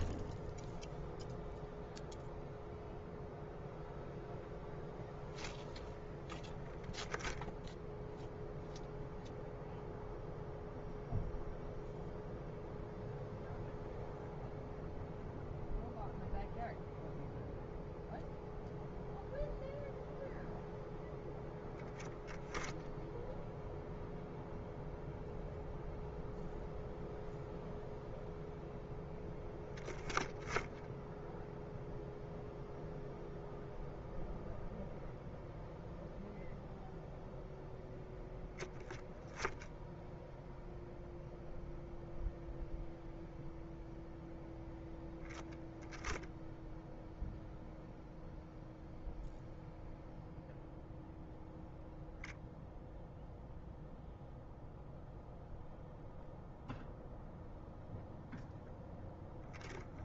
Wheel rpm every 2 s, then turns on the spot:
0, 0, 0, 0, 0, 0, 0, 0, 0, 0, 0, 0, 0, 0, 0, 0, 0, 0, 0, 0, 0, 0, 10, 0, 0, 0, 0, 0, 0, 0.
none